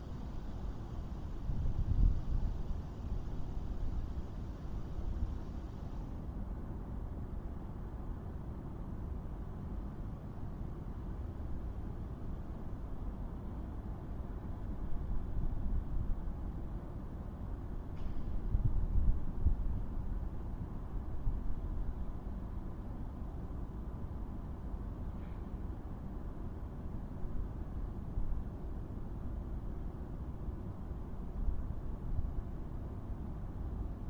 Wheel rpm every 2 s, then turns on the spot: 0, 0, 0, 0, 0, 0, 0, 0, 0, 0, 0, 0, 0, 0, 0, 0, 0.
none